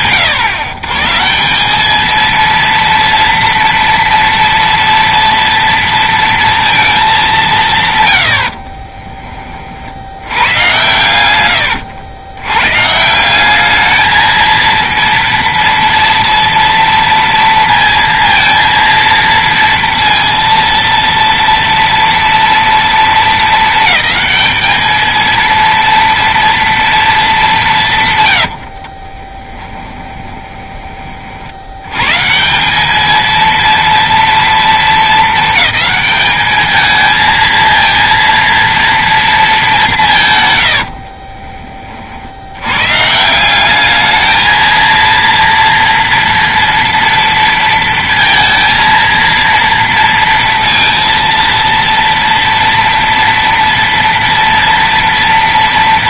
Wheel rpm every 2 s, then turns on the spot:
130, 230, 230, 210, 20, 100, 160, 230, 230, 230, 230, 220, 220, 230, 40, 20, 200, 220, 220, 230, 80, 110, 230, 230, 230, 230, 230, 230.
8-10 28-30 40-42